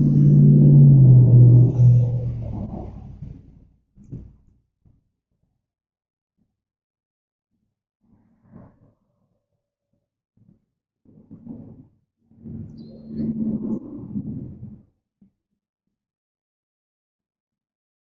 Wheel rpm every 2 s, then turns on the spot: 0, 0, 0, 0, 0, 0, 0, 0, 0.
none